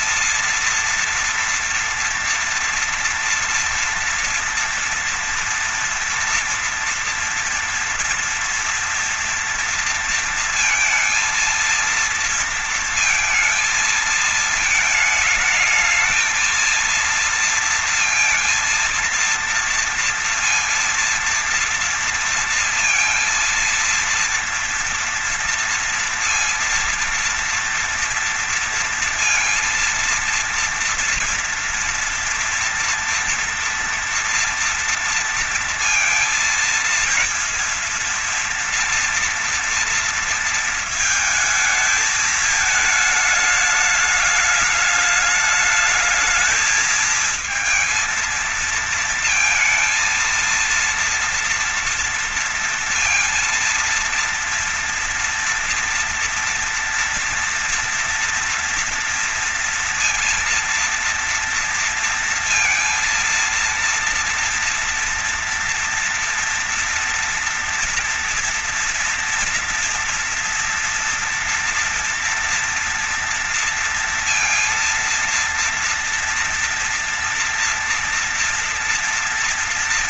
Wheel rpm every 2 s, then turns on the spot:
230, 240, 230, 230, 230, 230, 230, 220, 230, 230, 230, 230, 230, 230, 230, 230, 230, 230, 230, 230, 220, 220, 210, 230, 230, 230, 230, 230, 230, 230, 230, 230, 230, 230, 230, 230, 230, 230, 240, 230.
none